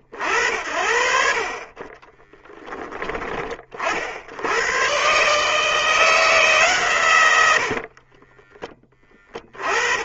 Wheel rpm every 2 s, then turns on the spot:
50, 10, 110, 130, 30.
none